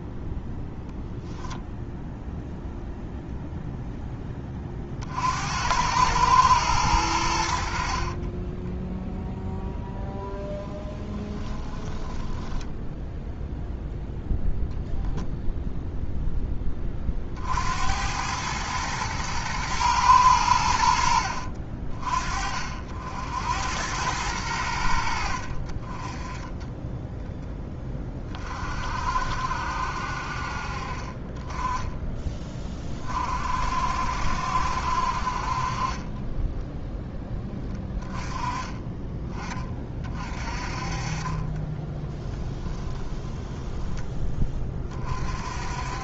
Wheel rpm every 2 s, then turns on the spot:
0, 0, 70, 100, 0, 10, 10, 0, 20, 110, 80, 60, 100, 10, 50, 40, 30, 60, 10, 30, 40, 10, 20.
10-12 42-44